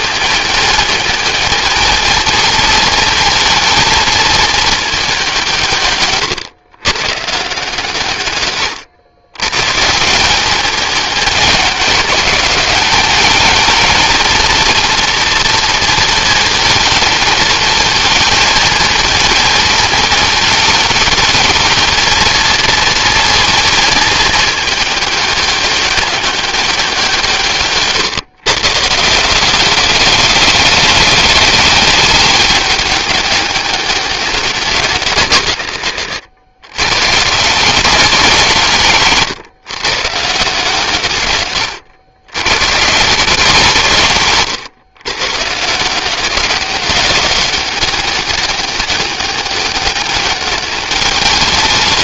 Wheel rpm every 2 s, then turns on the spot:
220, 230, 180, 140, 130, 200, 220, 230, 220, 220, 220, 230, 200, 150, 190, 210, 200, 120, 160, 130, 130, 150, 150, 200, 200, 190.
none